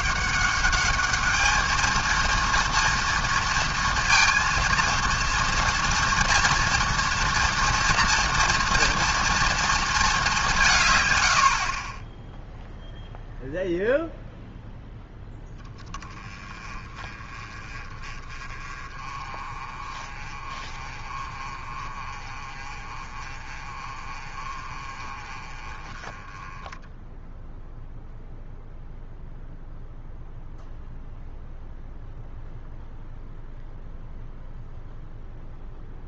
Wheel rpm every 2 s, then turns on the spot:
200, 230, 230, 230, 230, 170, 0, 0, 20, 30, 30, 30, 30, 10, 0, 0, 0, 0.
none